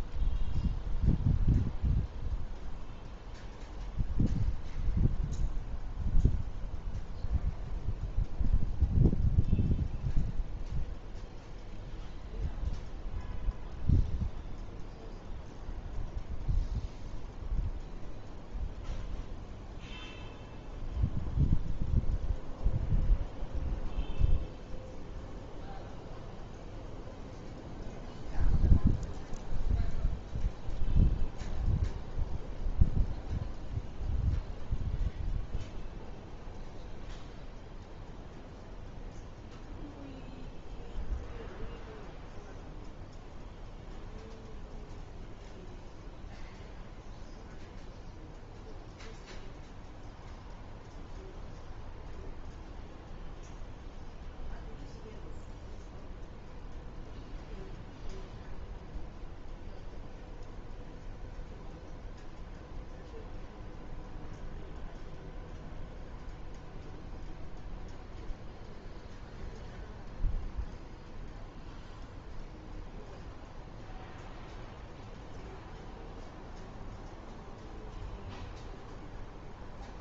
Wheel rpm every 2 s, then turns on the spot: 0, 0, 0, 0, 0, 0, 0, 0, 0, 0, 0, 0, 0, 0, 0, 0, 0, 0, 0, 0, 0, 0, 0, 0, 0, 0, 0, 0, 0, 0, 0, 0, 0, 0, 0, 0, 0, 0, 0, 0.
none